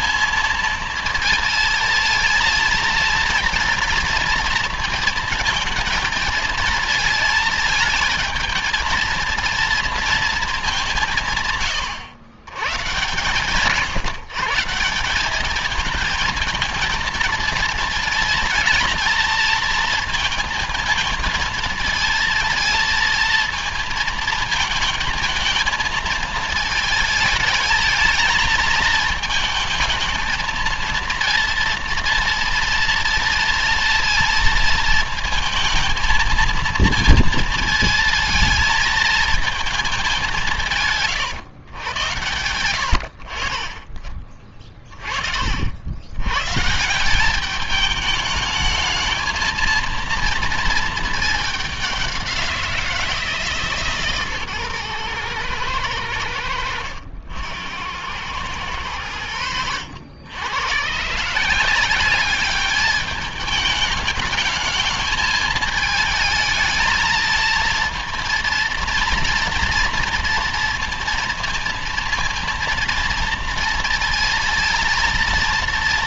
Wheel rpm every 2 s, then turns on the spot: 230, 230, 230, 220, 230, 180, 130, 180, 230, 220, 220, 230, 220, 220, 220, 230, 230, 230, 230, 220, 150, 80, 30, 170, 220, 220, 170, 120, 80, 100, 130, 210, 220, 220, 230, 230, 230, 230.
none